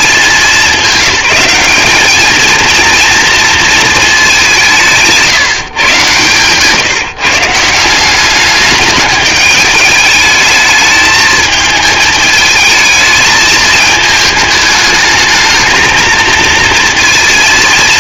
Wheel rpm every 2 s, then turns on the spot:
190, 240, 180, 150, 200, 210, 220, 220, 230.
none